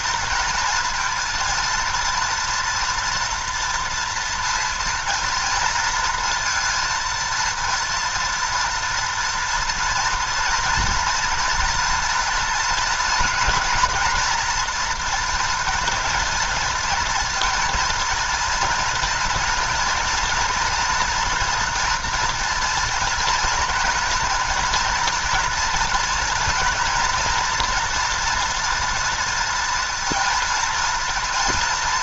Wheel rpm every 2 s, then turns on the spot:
230, 230, 230, 230, 240, 230, 230, 230, 230, 230, 230, 230, 230, 230, 230, 230.
none